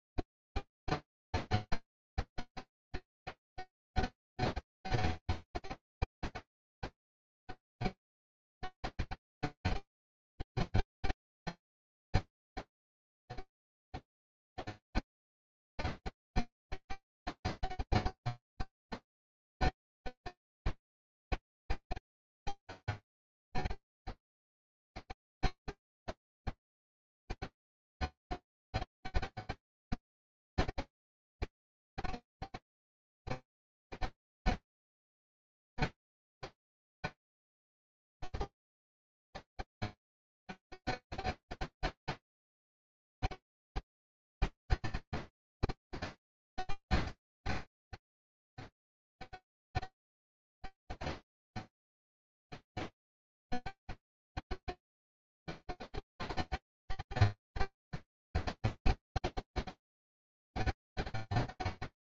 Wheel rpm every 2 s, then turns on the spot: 0, 0, 0, 0, 0, 0, 0, 0, 0, 0, 0, 0, 0, 0, 0, 0, 0, 0, 0, 0, 0, 0, 0, 0, 0, 0, 0, 0, 0, 0, 0.
none